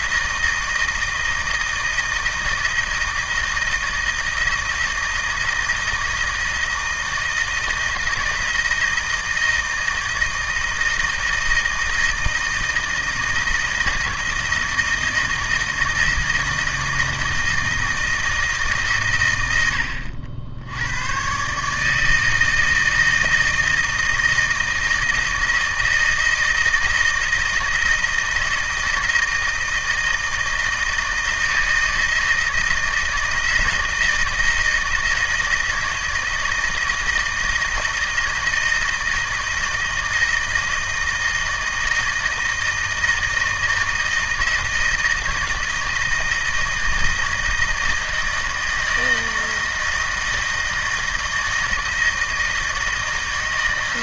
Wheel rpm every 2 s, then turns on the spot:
160, 160, 160, 160, 160, 160, 160, 160, 160, 140, 90, 160, 160, 160, 160, 160, 160, 160, 160, 160, 160, 160, 160, 160, 160, 160, 160.
none